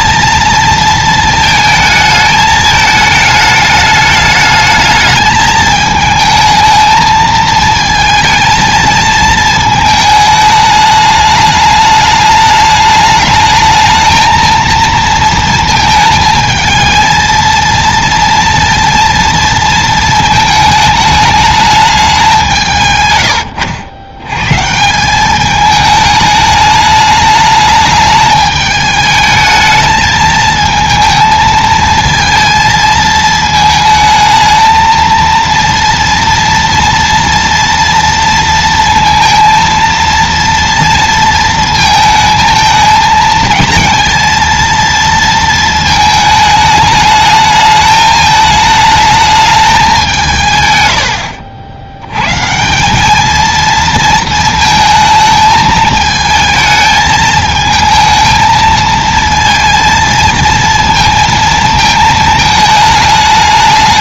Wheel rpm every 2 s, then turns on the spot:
230, 220, 210, 220, 220, 210, 210, 230, 220, 230, 220, 140, 160, 210, 210, 220, 220, 220, 230, 230, 230, 220, 230, 210, 220, 100, 180, 220, 220, 220, 230, 220.
22-24